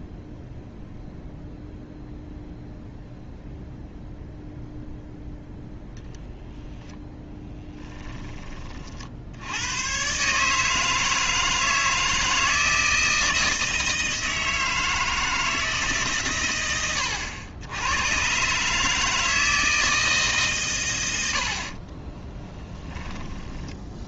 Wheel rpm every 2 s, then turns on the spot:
0, 0, 0, 0, 30, 150, 160, 160, 100, 150, 120, 10.
22-24